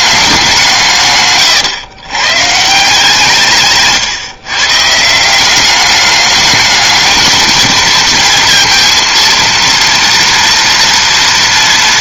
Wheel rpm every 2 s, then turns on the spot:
160, 150, 150, 210, 230, 230.
none